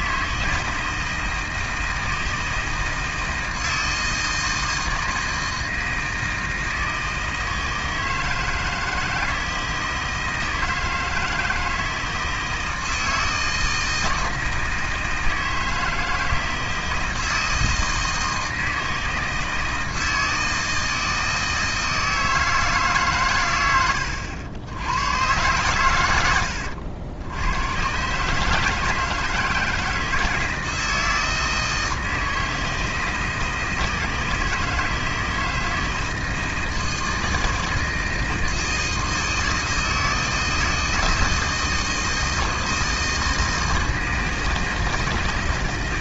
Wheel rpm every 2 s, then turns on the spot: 160, 160, 160, 160, 160, 160, 160, 160, 160, 160, 160, 140, 100, 90, 160, 160, 160, 160, 160, 160, 160, 160, 160.
none